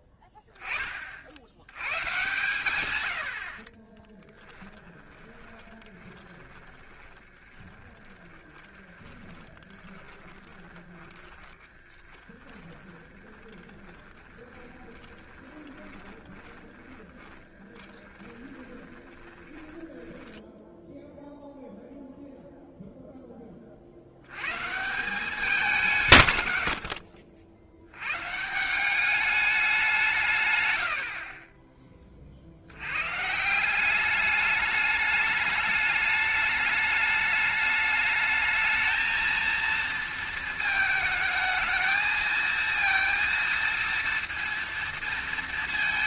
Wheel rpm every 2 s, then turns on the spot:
10, 110, 20, 30, 20, 20, 10, 20, 10, 20, 10, 0, 130, 50, 170, 110, 80, 210, 210, 220, 220, 230, 230.
4-22